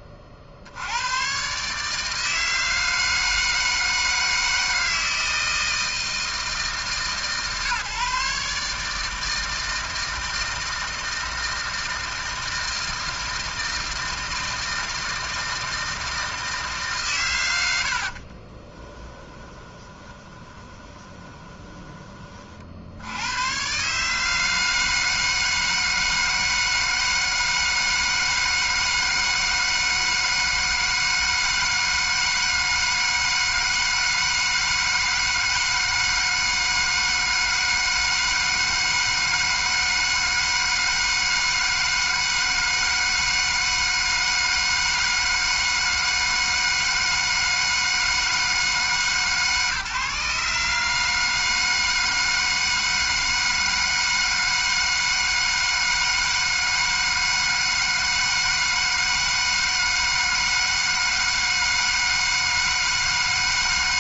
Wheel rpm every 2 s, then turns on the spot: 70, 160, 160, 150, 150, 160, 160, 160, 130, 20, 20, 80, 160, 160, 160, 160, 160, 160, 160, 160, 160, 160, 160, 160, 150, 150, 160, 160, 160, 160, 160, 160.
18-22